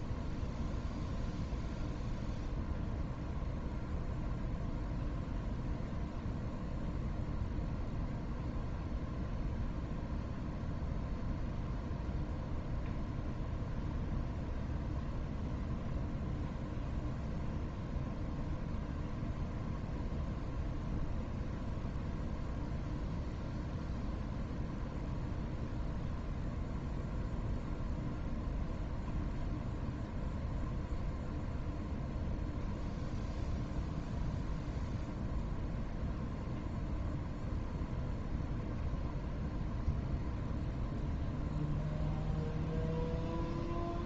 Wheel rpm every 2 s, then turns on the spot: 0, 0, 0, 0, 0, 0, 0, 0, 0, 0, 0, 0, 0, 0, 0, 0, 0, 0, 0, 0, 0, 0.
none